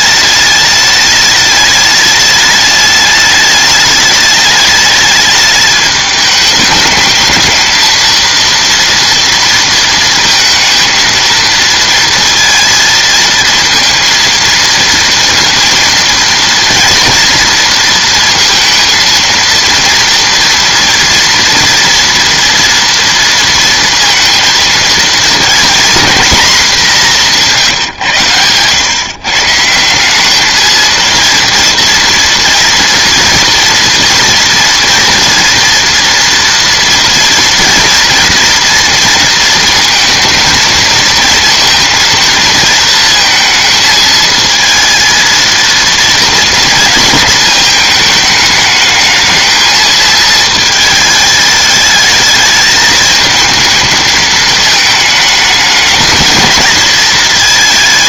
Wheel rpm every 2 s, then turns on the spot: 210, 210, 210, 210, 230, 230, 230, 230, 230, 230, 230, 230, 230, 210, 110, 220, 230, 230, 230, 230, 230, 230, 230, 230, 220, 220, 210, 220, 220.
none